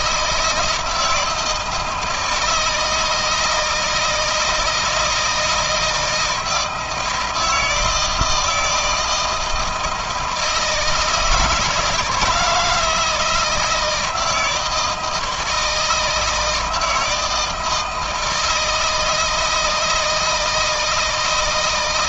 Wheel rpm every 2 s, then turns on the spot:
160, 160, 170, 160, 160, 160, 160, 160, 160, 160, 160.
none